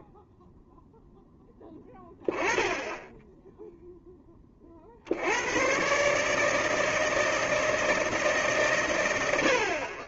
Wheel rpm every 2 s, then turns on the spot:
0, 10, 50, 160, 120.
none